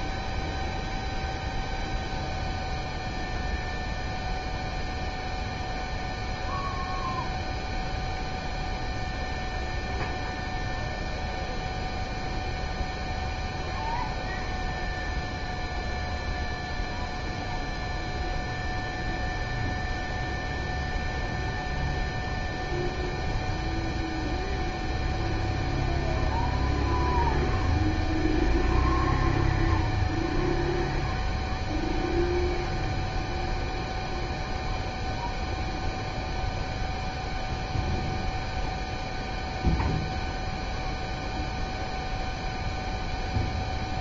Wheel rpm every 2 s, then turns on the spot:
0, 0, 0, 0, 0, 0, 0, 0, 0, 0, 0, 0, 0, 0, 0, 0, 0, 0, 0, 0, 0, 0.
none